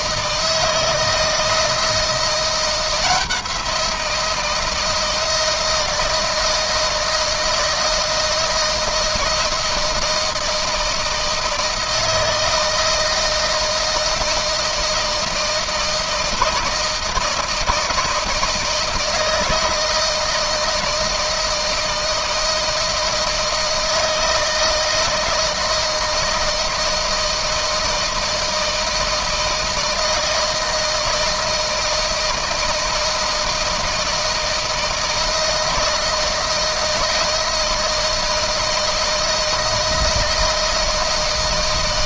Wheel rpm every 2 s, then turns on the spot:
160, 170, 170, 160, 170, 160, 160, 160, 160, 160, 160, 160, 160, 160, 160, 160, 160, 160, 160, 160, 160.
none